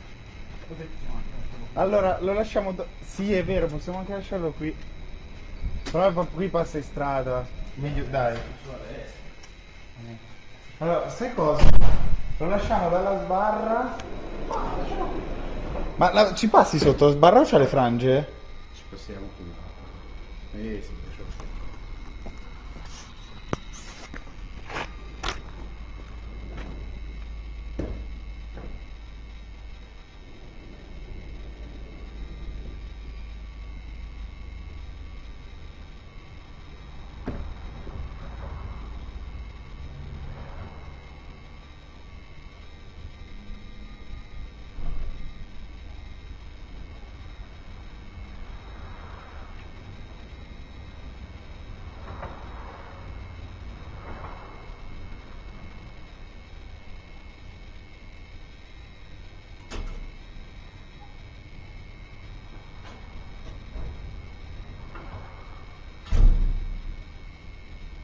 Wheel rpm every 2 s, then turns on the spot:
0, 0, 0, 0, 0, 0, 0, 0, 0, 0, 0, 0, 0, 0, 0, 0, 0, 0, 0, 0, 0, 0, 0, 0, 0, 0, 0, 0, 0, 0, 0, 0, 0, 0.
none